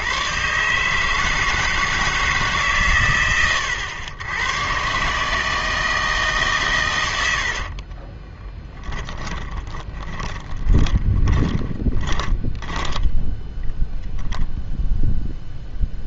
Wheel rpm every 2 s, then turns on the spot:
140, 140, 120, 130, 10, 30, 10, 0.
8-14